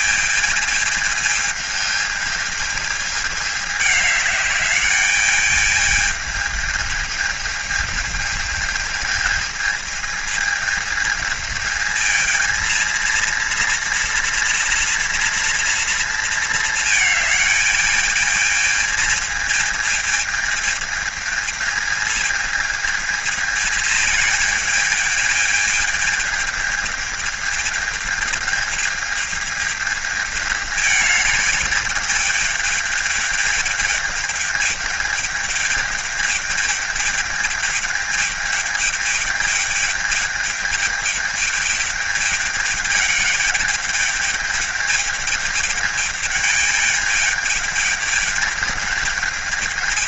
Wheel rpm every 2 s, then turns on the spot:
220, 210, 210, 220, 220, 220, 230, 230, 220, 220, 220, 220, 220, 220, 220, 210, 210, 210, 210, 210, 210, 210, 210, 210, 210.
none